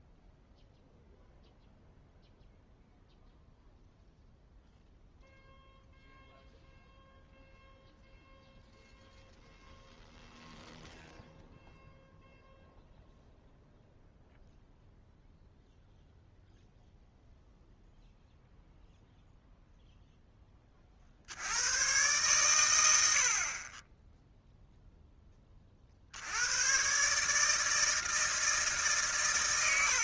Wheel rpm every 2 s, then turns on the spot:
0, 0, 0, 0, 0, 0, 0, 0, 0, 0, 20, 120, 0, 100, 160.
none